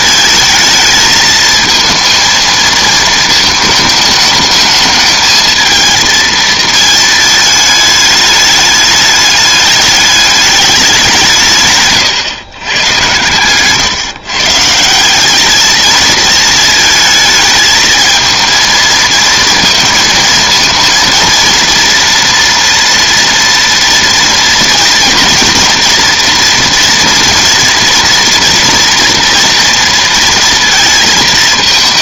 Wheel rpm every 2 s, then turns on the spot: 220, 230, 210, 220, 210, 200, 120, 150, 220, 220, 220, 230, 230, 230, 240, 230.
none